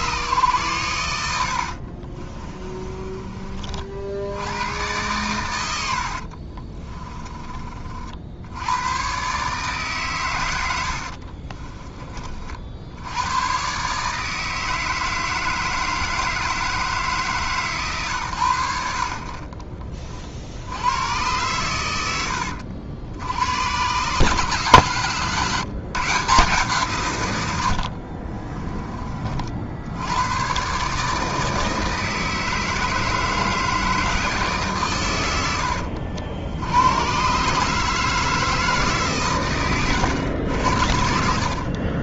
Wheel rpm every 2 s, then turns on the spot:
100, 20, 100, 20, 110, 80, 60, 160, 160, 60, 100, 70, 140, 150, 20, 140, 160, 130, 100, 160, 80.
2-4 6-8 10-12